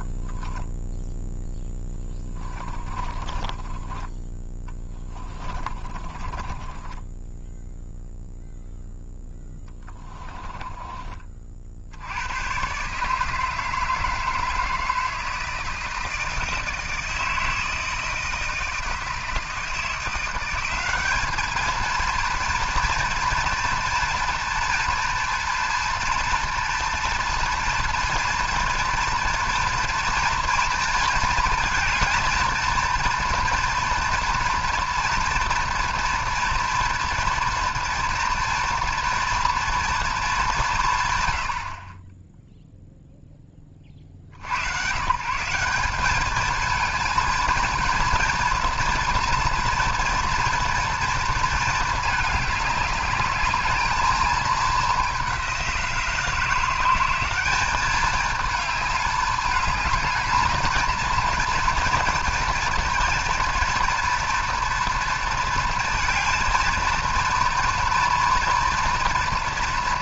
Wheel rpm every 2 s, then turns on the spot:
0, 10, 10, 20, 0, 20, 130, 160, 160, 160, 190, 230, 240, 230, 240, 230, 230, 240, 230, 230, 150, 0, 110, 230, 240, 230, 210, 210, 180, 210, 220, 230, 230, 230, 230.
2-4 6-8 10-12